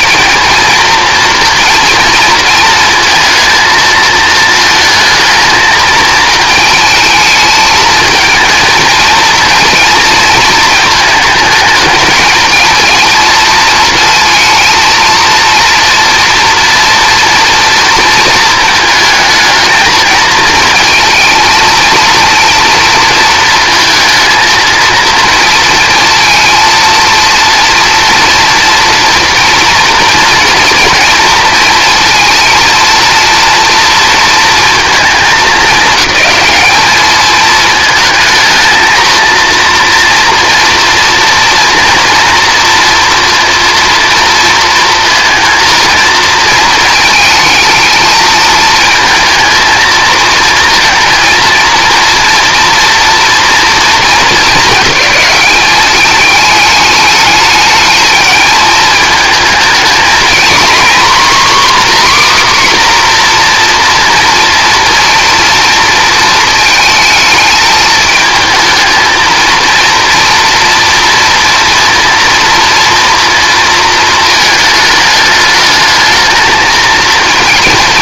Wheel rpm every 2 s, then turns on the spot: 230, 230, 220, 220, 230, 220, 230, 230, 230, 220, 220, 230, 230, 230, 230, 230, 230, 220, 210, 230, 230, 230, 230, 220, 220, 230, 240, 210, 210, 220, 260, 260, 230, 220, 220, 230, 230, 210, 220.
none